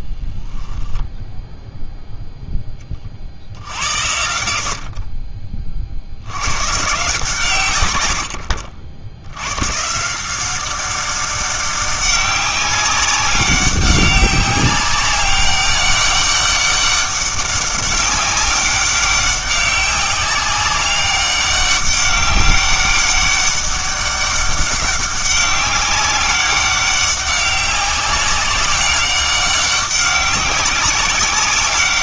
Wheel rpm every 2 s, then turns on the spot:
10, 10, 60, 120, 70, 190, 200, 190, 200, 200, 190, 200, 190, 200, 190, 200.
0-2